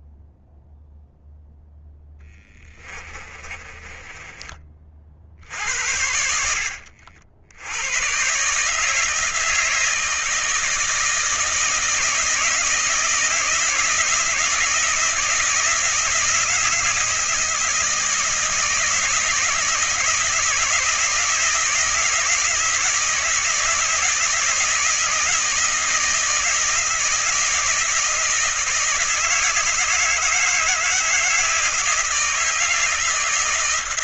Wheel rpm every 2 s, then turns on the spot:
10, 20, 70, 110, 160, 160, 170, 160, 160, 170, 160, 160, 160, 160, 160, 160, 160.
0-4